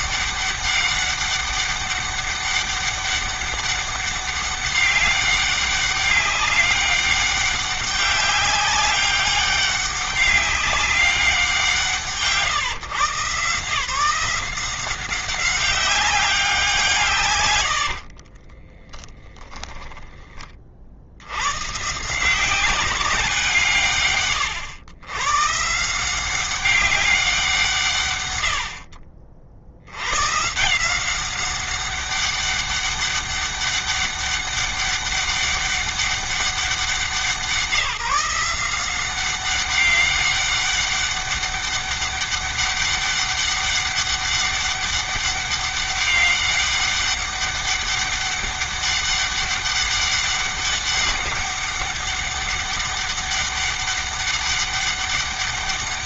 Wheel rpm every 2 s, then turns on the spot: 200, 200, 200, 200, 200, 200, 160, 180, 180, 40, 30, 200, 120, 180, 100, 130, 200, 200, 190, 170, 200, 200, 200, 200, 200, 200, 200, 200.
18-20